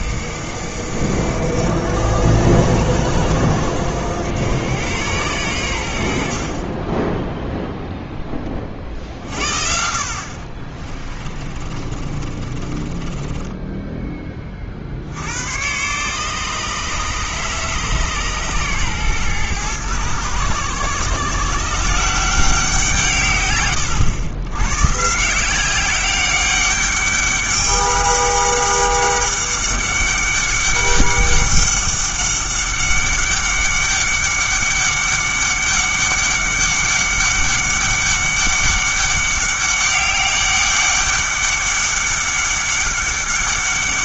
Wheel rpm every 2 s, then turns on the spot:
80, 80, 100, 30, 30, 40, 30, 50, 150, 130, 120, 170, 120, 200, 200, 200, 200, 200, 200, 200, 200, 200.
10-14